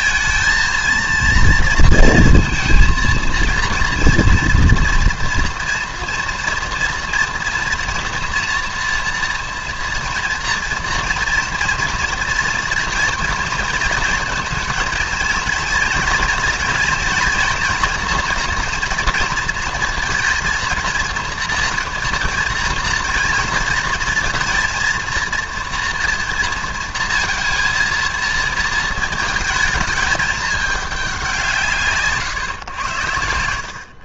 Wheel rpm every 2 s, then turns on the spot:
220, 230, 240, 240, 230, 230, 230, 220, 230, 230, 230, 230, 220, 230, 230, 210, 120.
none